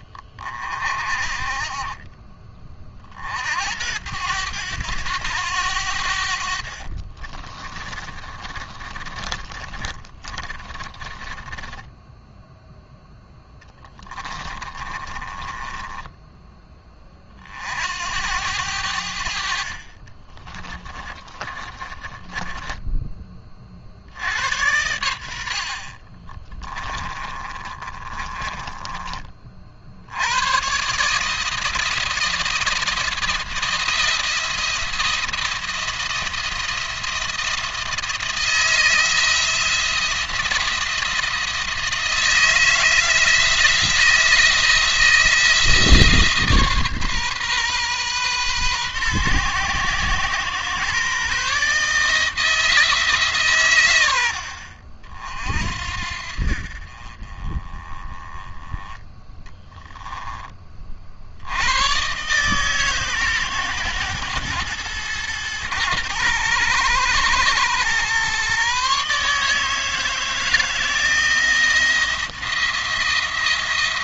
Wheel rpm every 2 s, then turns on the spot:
40, 40, 100, 50, 40, 20, 0, 20, 20, 80, 20, 20, 90, 20, 30, 140, 170, 170, 170, 170, 170, 160, 170, 140, 120, 140, 160, 60, 40, 10, 40, 140, 110, 110, 140, 160, 170.
6-12 14-16 20-22 26-30